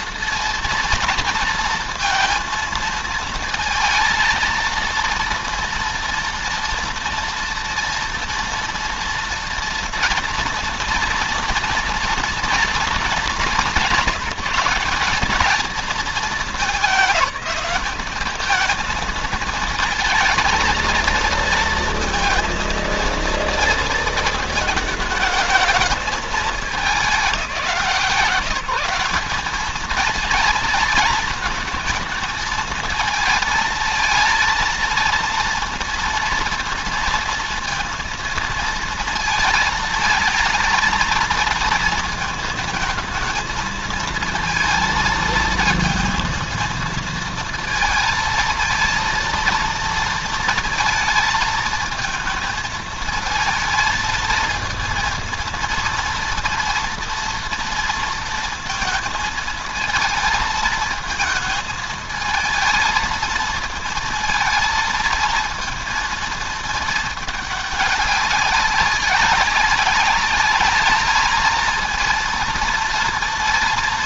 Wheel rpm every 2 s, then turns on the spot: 230, 230, 230, 230, 230, 230, 230, 200, 200, 220, 230, 230, 230, 210, 170, 220, 220, 230, 230, 230, 230, 230, 230, 230, 220, 220, 220, 230, 230, 230, 220, 220, 230, 220, 190, 200, 230.
none